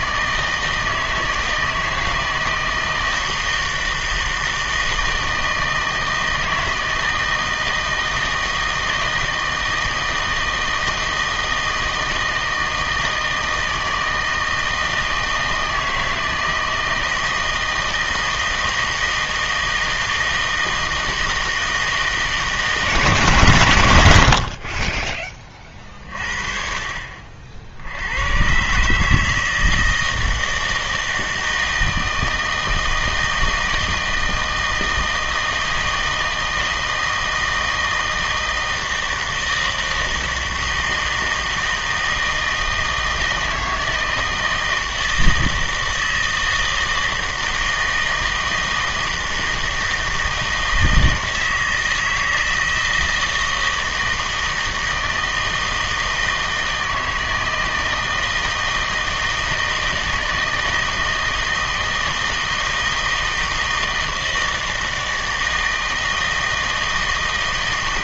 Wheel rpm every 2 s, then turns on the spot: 160, 160, 160, 160, 160, 160, 160, 160, 160, 160, 160, 150, 50, 40, 120, 160, 160, 160, 160, 160, 160, 160, 160, 160, 160, 160, 160, 160, 160, 160, 160, 160, 160, 160.
none